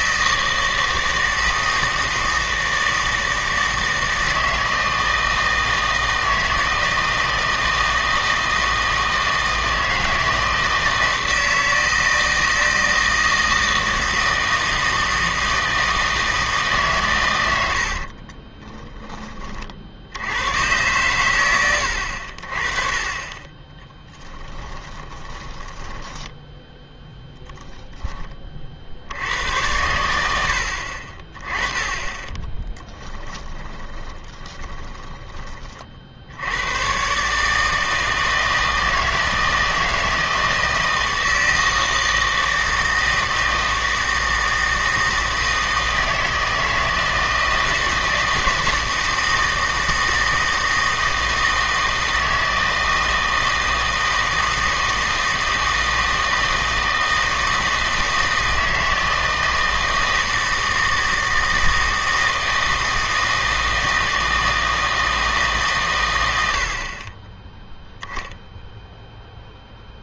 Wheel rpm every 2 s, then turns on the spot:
160, 160, 160, 160, 160, 160, 160, 160, 150, 10, 110, 40, 20, 10, 50, 70, 20, 20, 110, 160, 160, 160, 160, 160, 160, 160, 160, 160, 160, 160, 160, 160, 160, 60, 0.
18-20 24-28 32-36